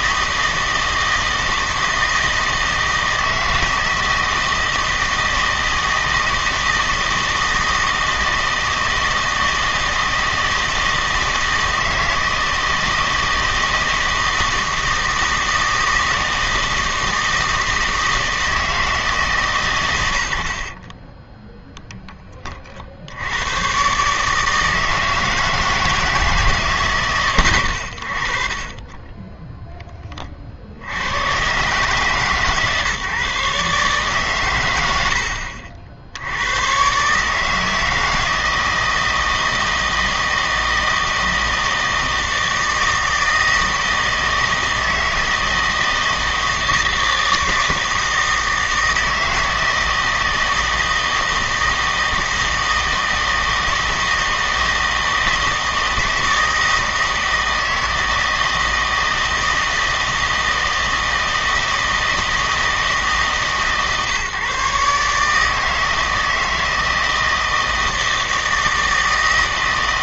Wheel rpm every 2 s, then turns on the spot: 160, 160, 160, 160, 160, 160, 160, 160, 160, 160, 50, 40, 160, 150, 30, 60, 150, 110, 110, 160, 160, 160, 160, 160, 160, 160, 160, 160, 160, 160, 160, 160, 140, 160, 160.
20-22